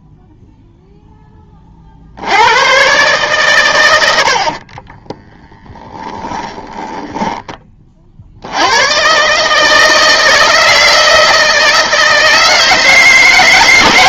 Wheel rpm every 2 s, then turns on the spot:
0, 80, 60, 10, 70, 160, 160.
6-8